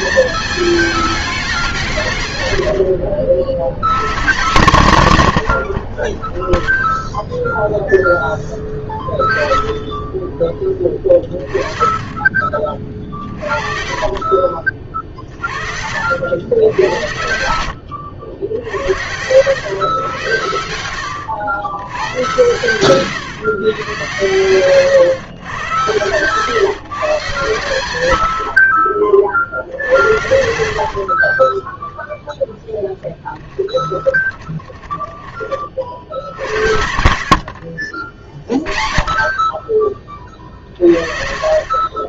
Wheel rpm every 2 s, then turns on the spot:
220, 120, 160, 0, 20, 20, 30, 40, 100, 80, 100, 120, 120, 150, 70, 70, 0, 20, 70, 40, 40.
8-10 12-16 20-22 34-36